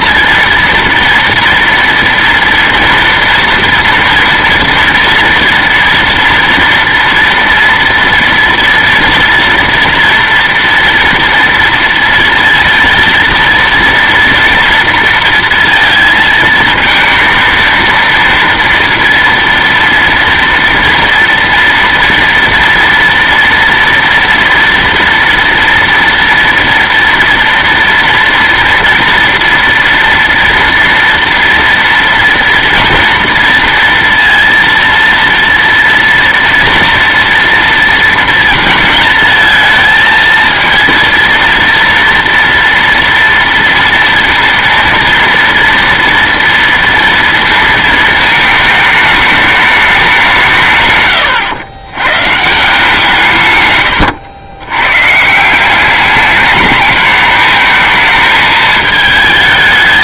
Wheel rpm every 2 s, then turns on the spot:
230, 230, 230, 230, 230, 240, 230, 230, 220, 230, 230, 230, 230, 230, 230, 230, 230, 230, 230, 230, 230, 230, 230, 230, 220, 140, 160, 120, 210, 220.
none